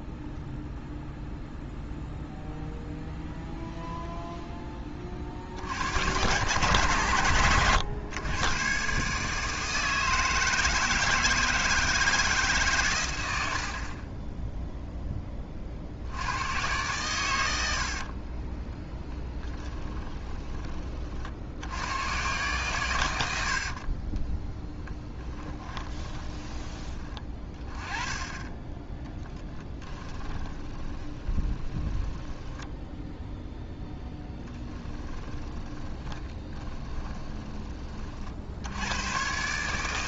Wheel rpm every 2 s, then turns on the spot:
0, 0, 10, 110, 130, 160, 130, 0, 110, 10, 30, 110, 10, 20, 20, 20, 10, 10, 20, 100.
18-20 24-26 28-38